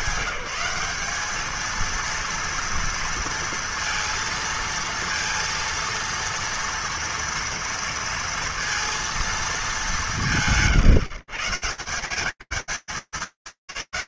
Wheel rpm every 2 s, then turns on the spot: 210, 230, 230, 230, 210, 130, 180.
none